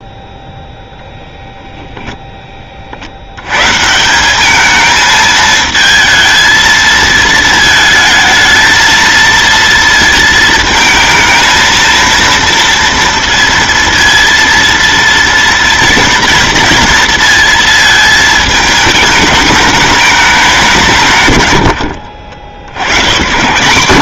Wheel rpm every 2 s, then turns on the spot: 0, 10, 180, 220, 220, 230, 230, 230, 230, 220, 200, 50.
none